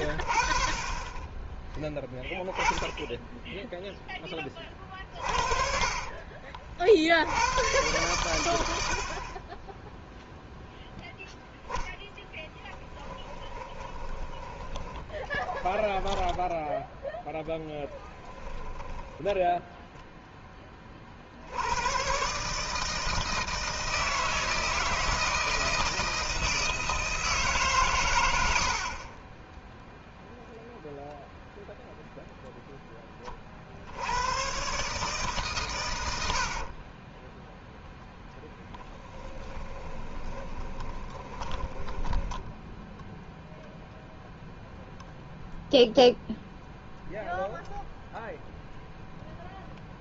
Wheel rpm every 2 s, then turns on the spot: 30, 10, 30, 60, 90, 0, 10, 20, 10, 10, 30, 150, 160, 160, 60, 0, 10, 130, 50, 10, 20, 0, 0, 0, 0.
4-6 12-20 36-42